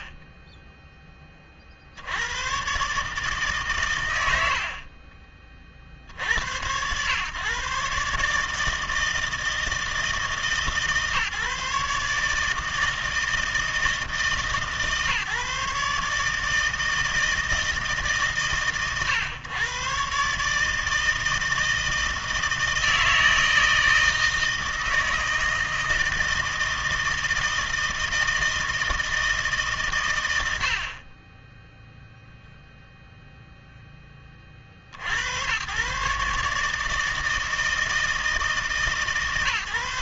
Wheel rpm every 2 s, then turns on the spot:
20, 120, 70, 90, 150, 150, 160, 150, 160, 130, 150, 160, 160, 160, 160, 80, 0, 50, 150, 150.
0-2